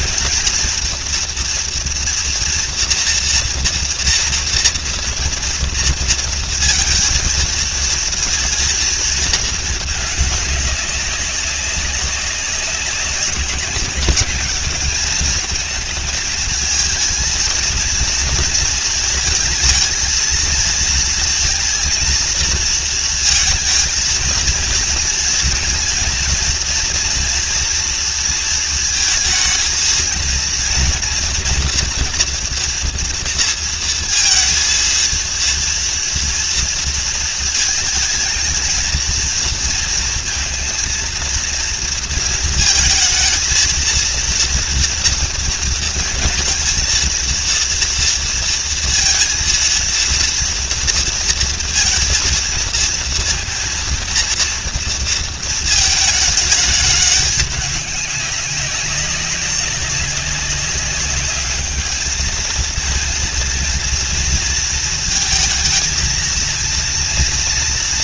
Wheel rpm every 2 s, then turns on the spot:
230, 230, 240, 230, 230, 200, 190, 220, 220, 220, 230, 230, 230, 240, 220, 230, 230, 230, 230, 230, 230, 220, 230, 230, 230, 230, 230, 230, 210, 200, 200, 230, 230, 230.
none